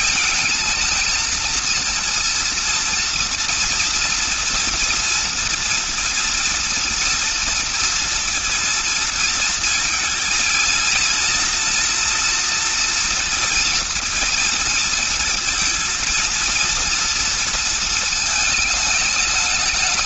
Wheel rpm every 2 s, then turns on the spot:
230, 230, 230, 230, 230, 230, 230, 230, 230, 210.
none